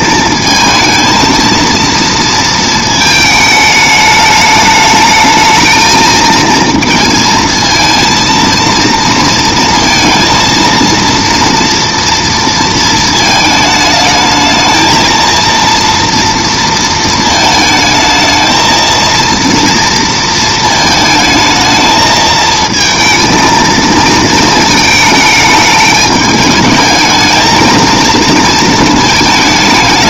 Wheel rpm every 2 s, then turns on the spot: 220, 220, 210, 230, 230, 230, 230, 220, 230, 230, 220, 220, 220, 220, 220.
none